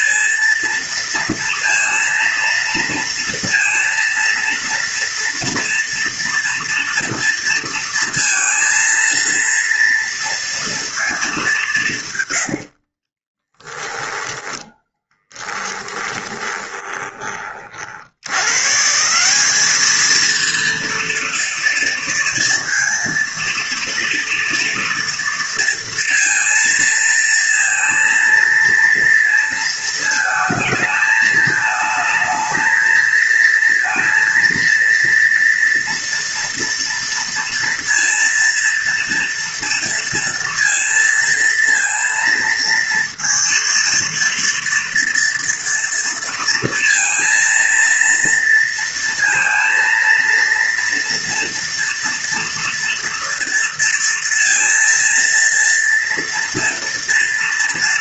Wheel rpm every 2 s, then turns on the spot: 230, 230, 230, 230, 230, 220, 40, 20, 20, 160, 230, 230, 230, 230, 230, 220, 230, 230, 230, 230, 230, 230, 240, 230, 230, 240, 230, 230, 230.
12-18